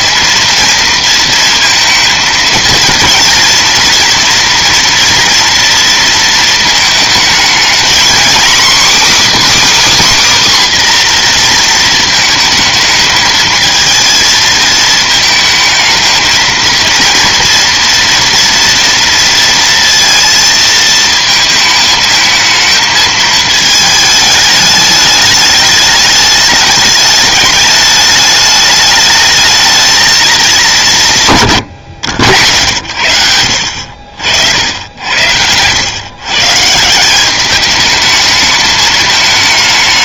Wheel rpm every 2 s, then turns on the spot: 230, 230, 230, 220, 250, 280, 220, 220, 230, 230, 230, 220, 210, 210, 210, 200, 90, 70, 130, 210.
none